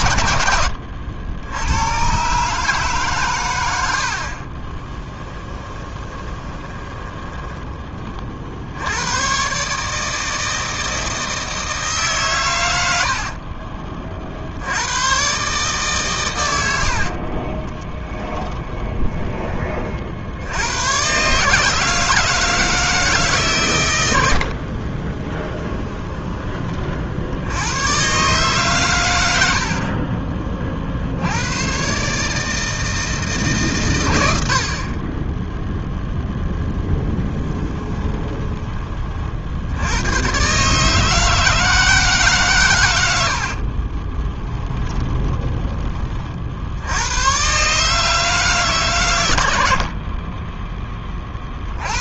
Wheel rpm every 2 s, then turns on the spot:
80, 140, 30, 20, 90, 160, 120, 90, 80, 20, 110, 160, 40, 40, 120, 50, 160, 40, 10, 30, 140, 120, 20, 80, 130, 20.
0-2 4-8 16-20 24-26 44-46